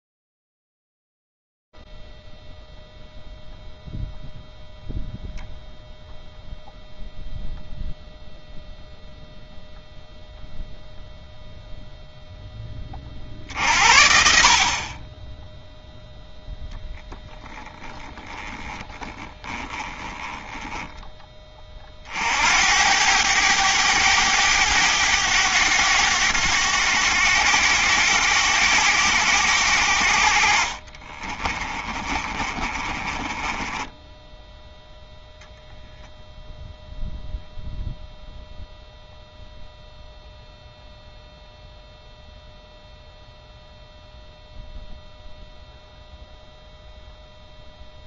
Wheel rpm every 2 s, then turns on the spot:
0, 0, 0, 0, 0, 0, 10, 50, 0, 10, 10, 80, 100, 90, 90, 50, 30, 0, 0, 0, 0, 0, 0, 0.
18-20 30-34